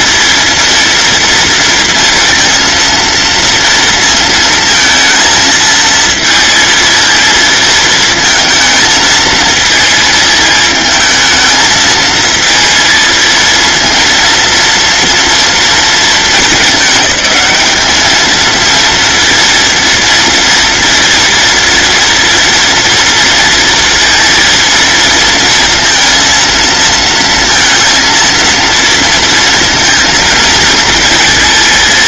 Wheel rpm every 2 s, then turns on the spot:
230, 230, 230, 230, 220, 220, 230, 230, 210, 230, 230, 230, 230, 230, 230, 230.
none